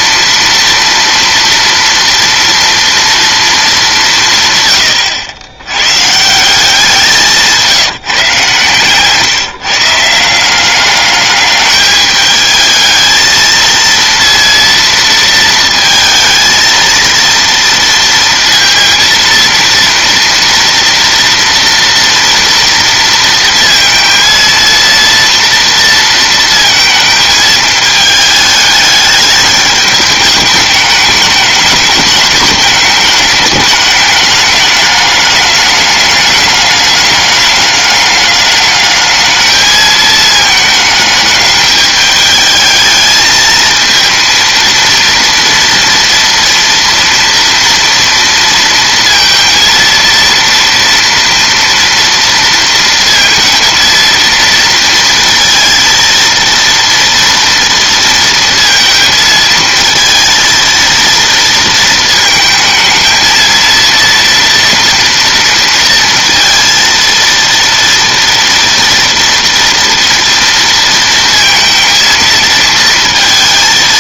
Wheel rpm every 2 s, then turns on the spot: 230, 230, 130, 180, 150, 190, 220, 230, 230, 230, 230, 230, 230, 230, 210, 210, 210, 210, 200, 200, 210, 210, 230, 230, 230, 230, 230, 230, 230, 230, 230, 220, 230, 230, 230, 230, 230.
none